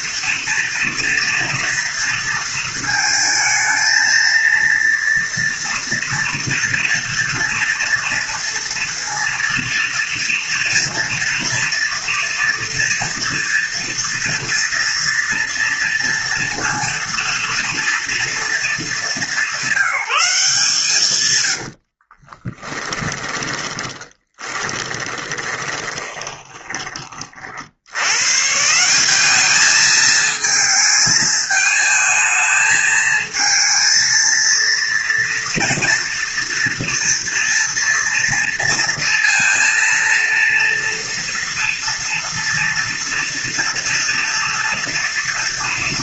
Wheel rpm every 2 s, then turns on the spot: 230, 230, 230, 230, 230, 230, 230, 240, 230, 220, 160, 20, 20, 20, 150, 220, 220, 230, 230, 230, 230, 230, 230.
22-28